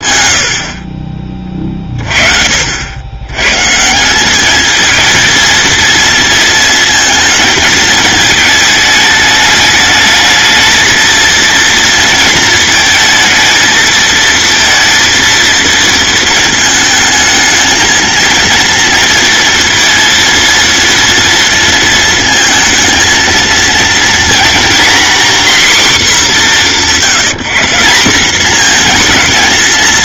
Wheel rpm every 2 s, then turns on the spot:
60, 70, 220, 230, 220, 220, 220, 230, 230, 230, 230, 220, 250, 190, 220.
none